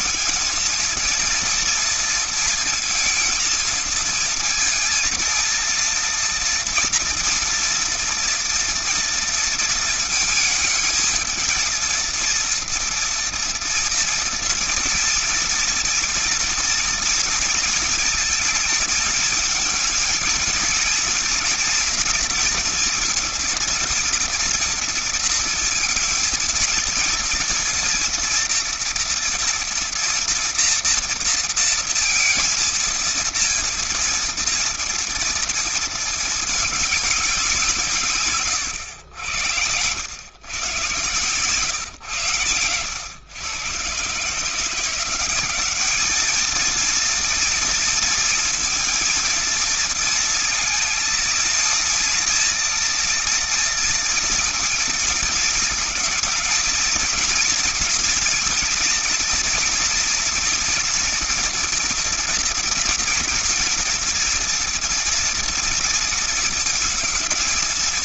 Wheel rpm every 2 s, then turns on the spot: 230, 230, 230, 230, 230, 220, 230, 230, 230, 230, 220, 230, 240, 230, 240, 230, 230, 230, 220, 130, 110, 120, 150, 220, 230, 230, 230, 230, 230, 240, 240, 230, 230, 230.
none